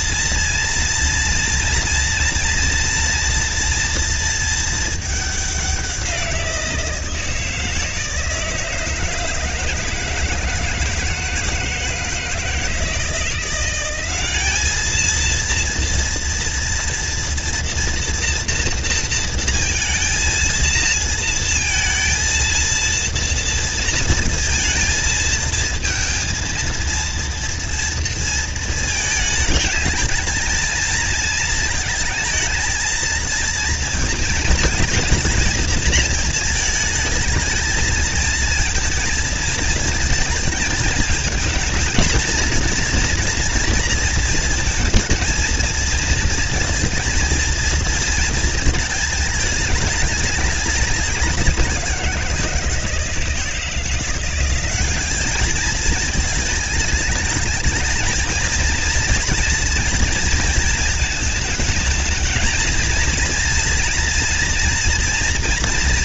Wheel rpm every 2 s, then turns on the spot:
230, 240, 230, 180, 160, 160, 160, 200, 230, 230, 230, 230, 230, 230, 230, 220, 220, 220, 220, 220, 220, 230, 230, 230, 230, 210, 170, 180, 220, 220, 230, 220, 230.
none